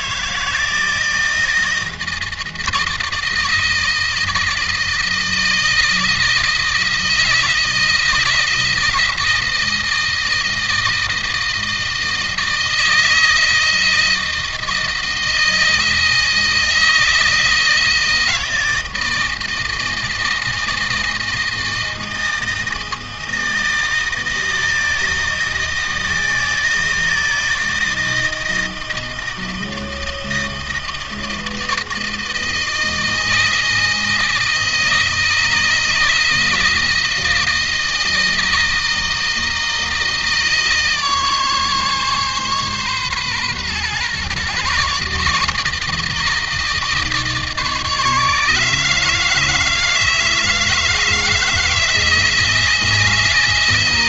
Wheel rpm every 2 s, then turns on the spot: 160, 160, 160, 160, 160, 160, 160, 160, 160, 160, 160, 160, 160, 160, 160, 160, 160, 160, 160, 160, 150, 130, 140, 150, 160, 160, 160.
none